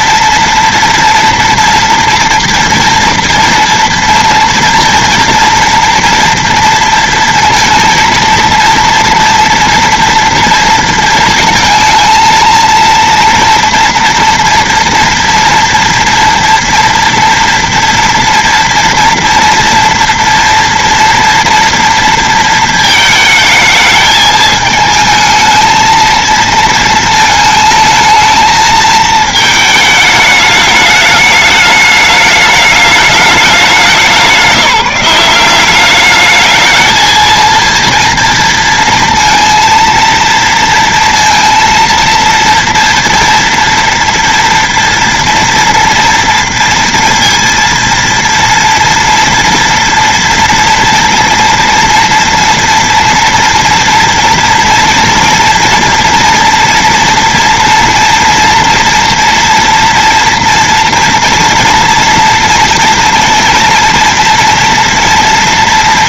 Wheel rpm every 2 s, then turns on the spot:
230, 230, 230, 230, 240, 230, 230, 240, 240, 230, 240, 220, 220, 220, 220, 210, 210, 180, 220, 230, 230, 230, 230, 230, 230, 230, 240, 230, 230, 240, 230, 230, 230.
none